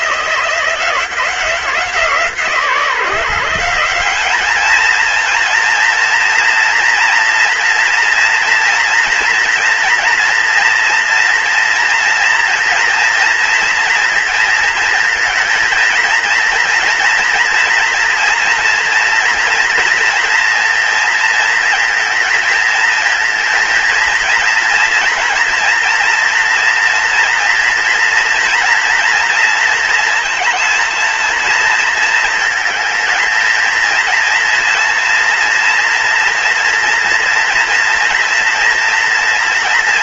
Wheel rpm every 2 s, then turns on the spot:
170, 160, 210, 230, 230, 230, 230, 230, 230, 230, 230, 230, 230, 240, 240, 230, 220, 230, 230, 240.
none